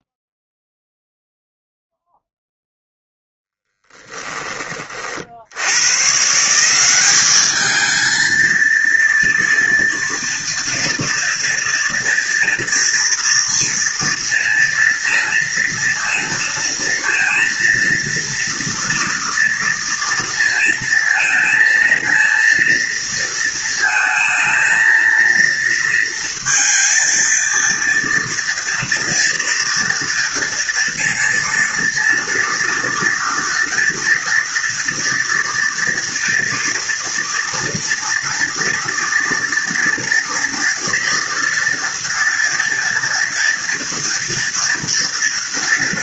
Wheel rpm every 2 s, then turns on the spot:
0, 0, 30, 170, 230, 230, 230, 230, 230, 230, 230, 230, 230, 230, 230, 230, 230, 230, 230, 230, 230, 230, 230.
4-6